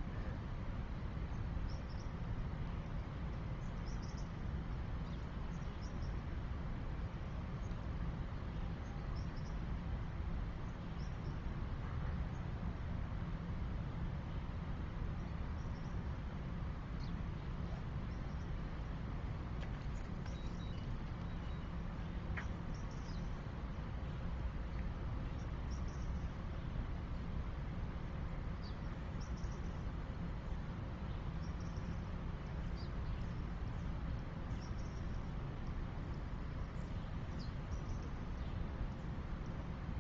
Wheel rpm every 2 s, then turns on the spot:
0, 0, 0, 0, 0, 0, 0, 0, 0, 0, 0, 0, 0, 0, 0, 0, 0, 0, 0, 0.
none